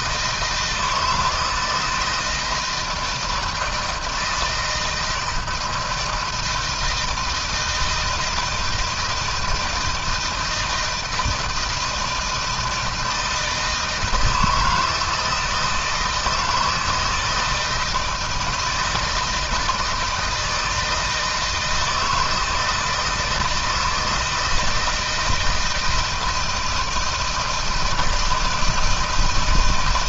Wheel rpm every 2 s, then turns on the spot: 170, 160, 160, 160, 160, 160, 160, 160, 160, 160, 160, 160, 160, 160, 160.
none